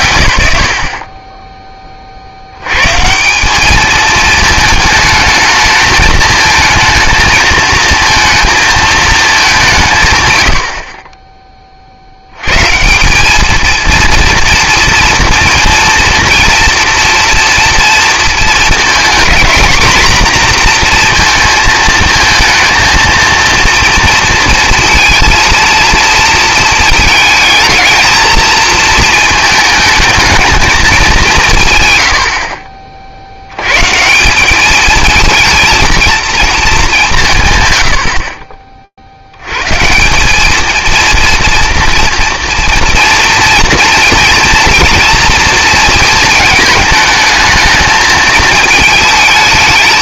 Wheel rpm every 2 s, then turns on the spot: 110, 90, 220, 220, 230, 100, 120, 230, 240, 230, 240, 230, 230, 230, 220, 220, 50, 200, 220, 60, 230, 230, 230, 220, 220.
none